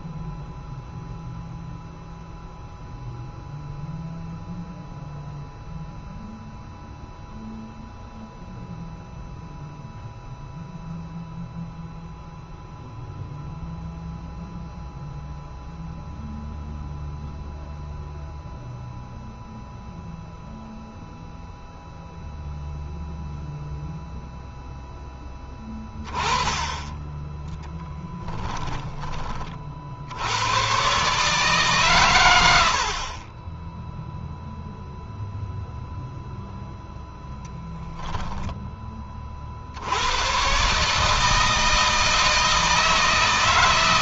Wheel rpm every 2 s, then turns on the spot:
0, 0, 0, 0, 0, 0, 0, 0, 0, 0, 0, 0, 0, 10, 10, 110, 80, 0, 0, 10, 130, 160.
none